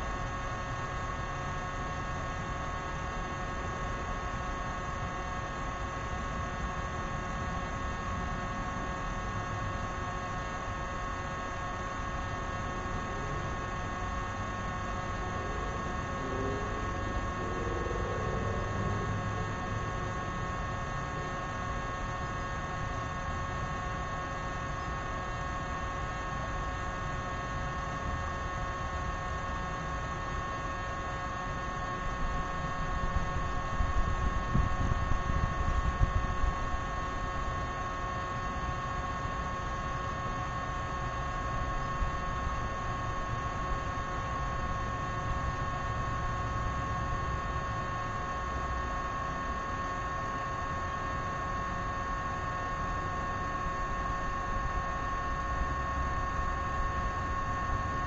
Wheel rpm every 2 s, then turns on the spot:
0, 0, 0, 0, 0, 0, 0, 0, 0, 0, 0, 0, 0, 0, 0, 0, 0, 0, 0, 0, 0, 0, 0, 0, 0, 0, 0, 0, 0.
none